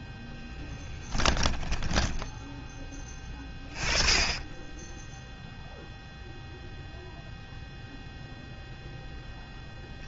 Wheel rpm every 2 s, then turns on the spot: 20, 10, 0, 0, 0.
none